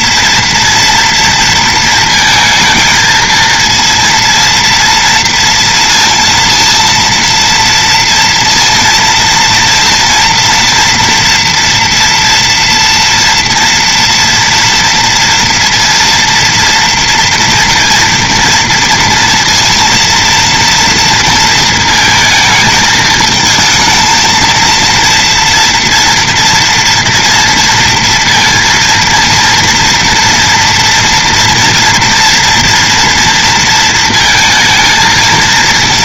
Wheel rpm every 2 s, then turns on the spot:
230, 230, 230, 230, 230, 230, 230, 230, 230, 230, 230, 220, 230, 230, 230, 230, 240, 230.
none